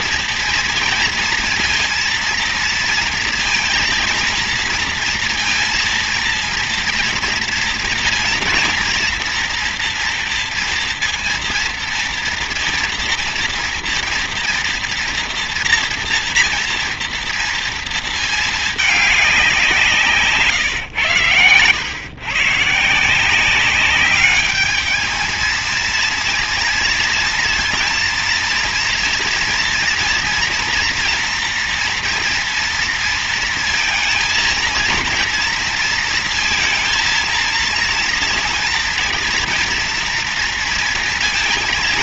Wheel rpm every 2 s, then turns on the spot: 230, 230, 230, 230, 230, 230, 230, 230, 230, 200, 120, 170, 220, 230, 230, 230, 230, 230, 230, 230, 230.
none